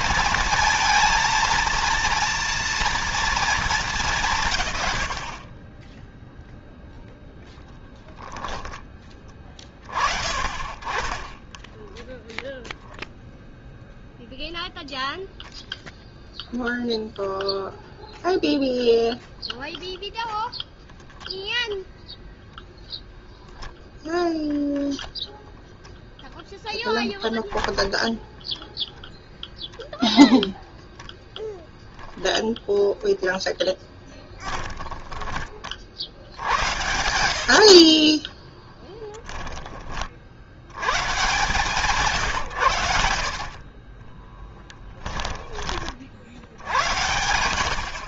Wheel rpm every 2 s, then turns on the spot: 230, 230, 110, 0, 20, 30, 0, 0, 0, 0, 0, 0, 0, 0, 0, 0, 10, 10, 80, 0, 110, 90, 10, 100.
10-12 32-36 42-46